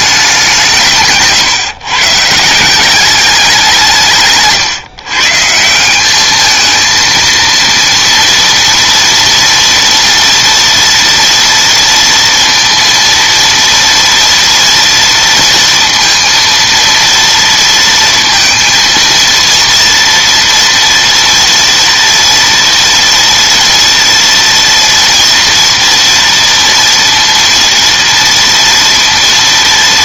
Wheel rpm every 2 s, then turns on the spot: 170, 180, 140, 220, 230, 230, 230, 230, 230, 230, 230, 230, 230, 230, 230.
none